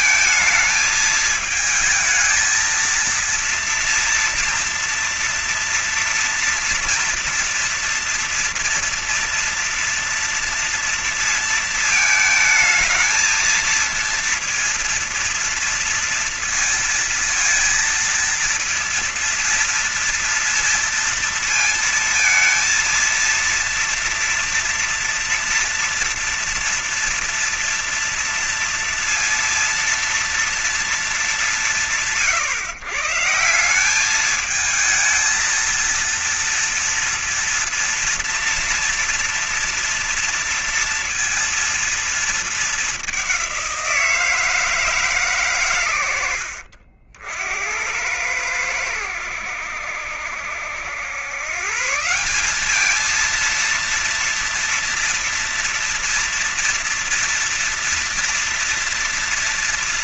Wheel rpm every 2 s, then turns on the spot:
220, 220, 230, 230, 230, 230, 220, 230, 230, 230, 230, 230, 230, 230, 230, 230, 130, 200, 230, 230, 230, 220, 170, 90, 90, 70, 170, 230, 230, 230.
none